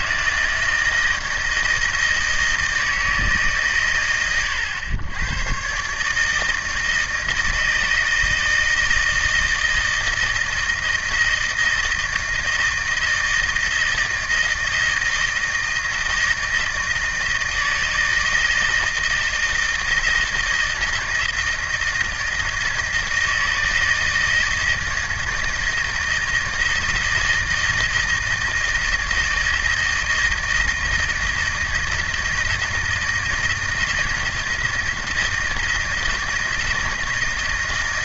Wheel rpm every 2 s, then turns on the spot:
160, 160, 110, 160, 160, 160, 160, 160, 160, 160, 160, 160, 160, 160, 160, 160, 160, 160, 160.
none